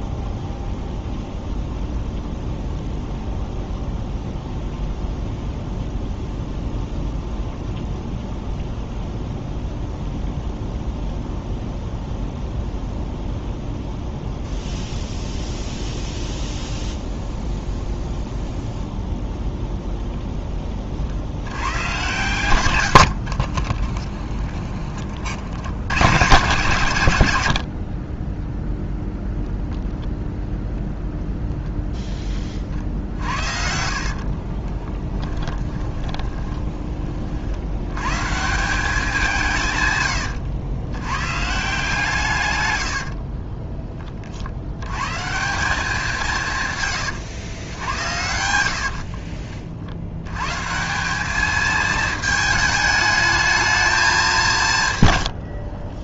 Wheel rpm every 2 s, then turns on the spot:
0, 0, 0, 0, 0, 0, 0, 0, 0, 0, 40, 100, 30, 110, 0, 0, 50, 10, 30, 180, 110, 60, 110, 120, 50, 180, 210, 130.
22-24 32-36 42-44 48-50